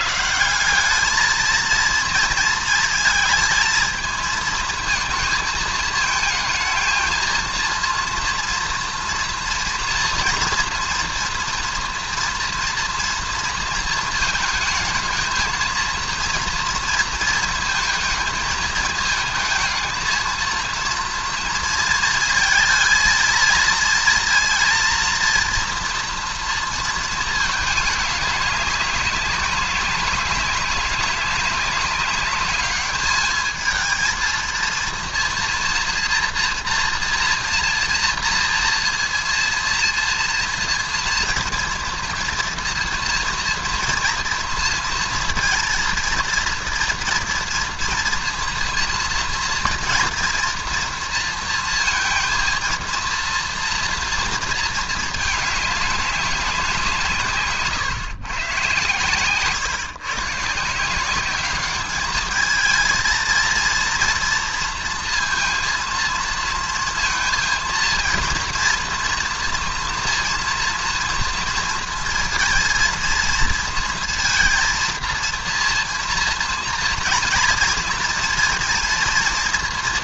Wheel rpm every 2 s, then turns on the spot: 150, 230, 220, 220, 230, 240, 230, 230, 230, 220, 230, 220, 230, 230, 200, 190, 200, 230, 230, 230, 230, 230, 230, 230, 240, 230, 230, 230, 210, 130, 140, 210, 230, 230, 230, 230, 230, 230, 230, 230.
none